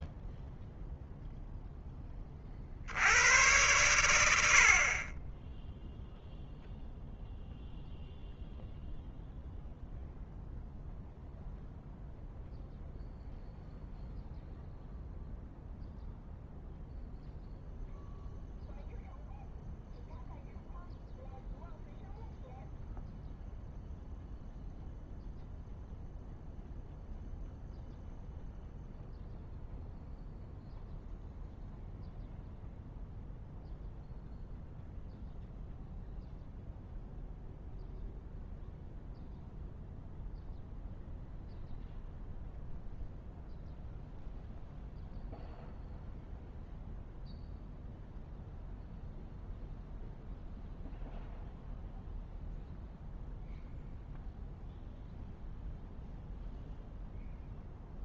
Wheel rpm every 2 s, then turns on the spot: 0, 30, 80, 0, 0, 0, 0, 0, 0, 0, 0, 0, 0, 0, 0, 0, 0, 0, 0, 0, 0, 0, 0, 0, 0, 0, 0, 0, 0.
none